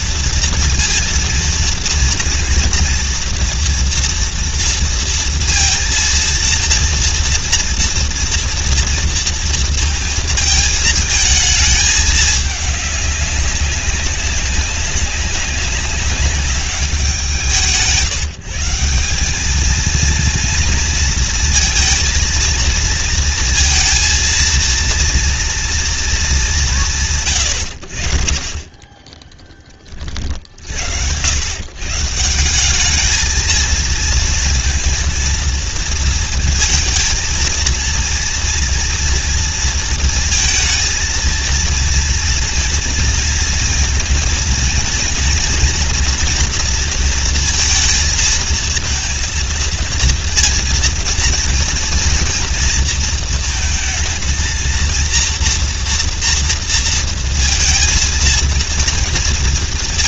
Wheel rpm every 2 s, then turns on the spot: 240, 230, 230, 230, 230, 220, 210, 200, 200, 180, 230, 230, 230, 170, 30, 60, 190, 230, 230, 230, 230, 230, 230, 230, 220, 230, 230, 230, 230, 230.
none